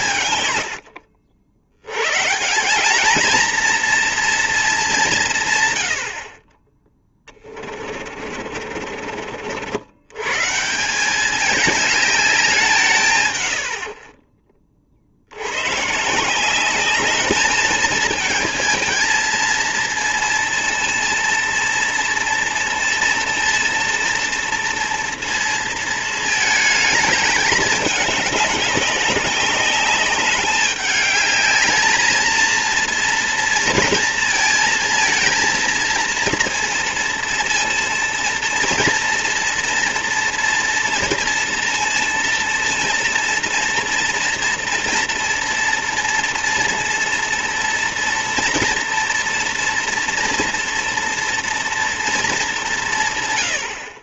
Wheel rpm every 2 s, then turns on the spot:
100, 190, 210, 10, 50, 160, 170, 30, 200, 230, 230, 230, 230, 220, 200, 200, 230, 230, 230, 230, 230, 230, 230, 230, 240, 230, 190.
0-2 8-10